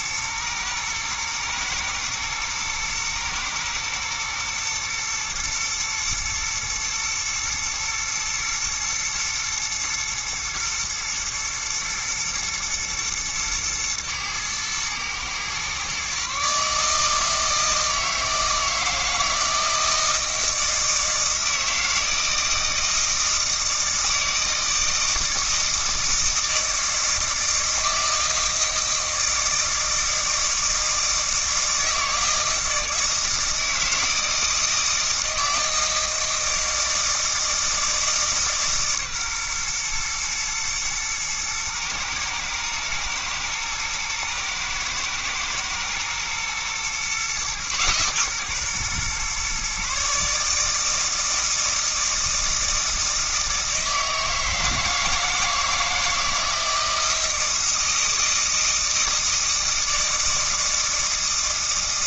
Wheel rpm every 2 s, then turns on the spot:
110, 110, 120, 120, 120, 120, 110, 110, 150, 160, 160, 160, 160, 160, 160, 160, 160, 160, 160, 140, 110, 110, 110, 120, 130, 160, 160, 160, 160, 160, 160.
none